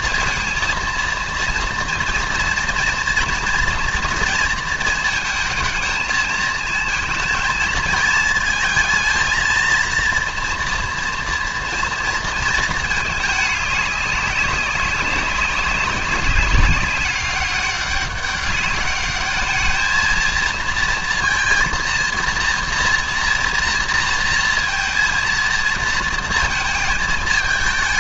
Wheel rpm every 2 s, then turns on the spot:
230, 230, 230, 220, 230, 240, 220, 190, 200, 200, 230, 230, 230, 220.
none